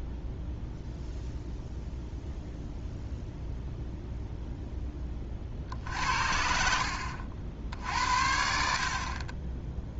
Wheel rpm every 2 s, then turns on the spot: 0, 0, 0, 60, 60.
none